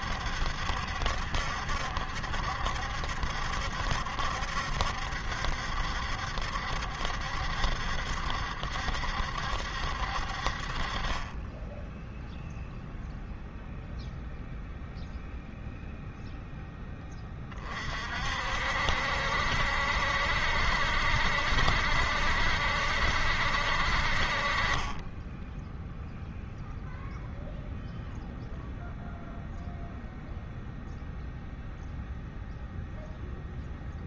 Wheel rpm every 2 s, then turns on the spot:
70, 70, 70, 70, 70, 50, 0, 0, 0, 60, 70, 70, 40, 0, 0, 0, 0.
none